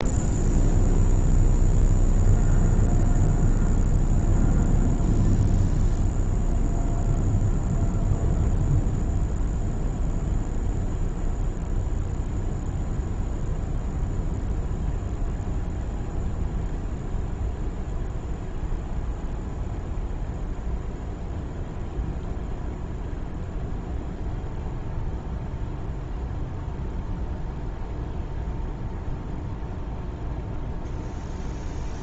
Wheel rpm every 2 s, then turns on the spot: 0, 0, 0, 0, 0, 0, 0, 0, 0, 0, 0, 0, 0, 0, 0, 0.
none